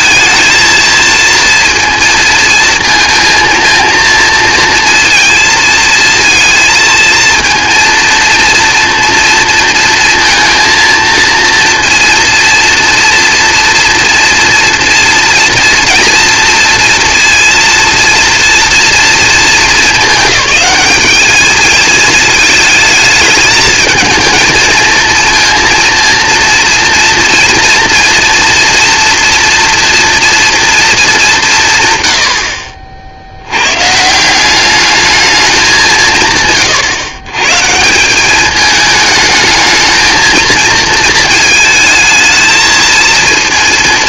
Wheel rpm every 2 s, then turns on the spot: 220, 230, 230, 230, 230, 230, 230, 230, 230, 230, 210, 220, 230, 230, 240, 220, 60, 210, 140, 220, 230, 220.
none